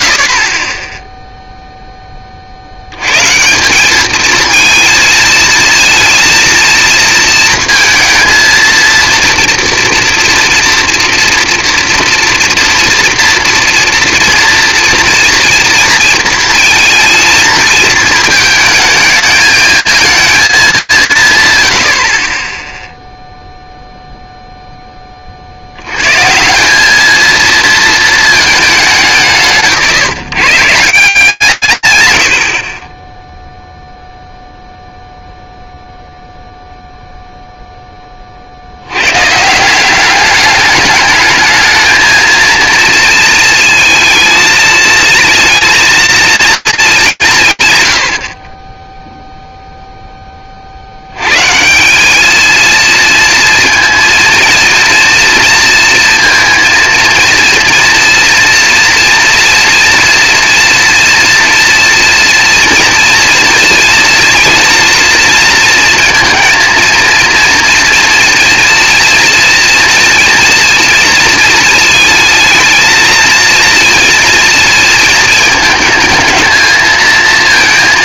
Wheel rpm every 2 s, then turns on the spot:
0, 100, 220, 230, 230, 230, 230, 230, 220, 220, 170, 0, 30, 220, 160, 170, 10, 0, 0, 170, 220, 230, 230, 140, 0, 170, 230, 230, 230, 230, 230, 230, 230, 230, 230, 220, 230, 220, 230.
none